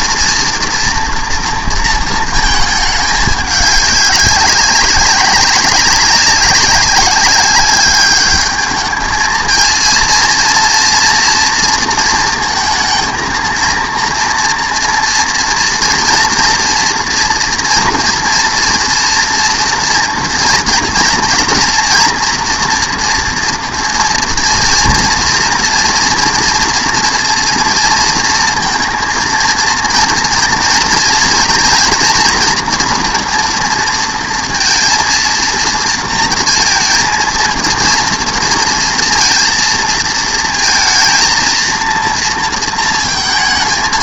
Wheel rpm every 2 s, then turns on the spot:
230, 220, 200, 200, 210, 230, 230, 230, 230, 230, 230, 240, 230, 230, 230, 220, 230, 230, 230, 230, 230, 230.
none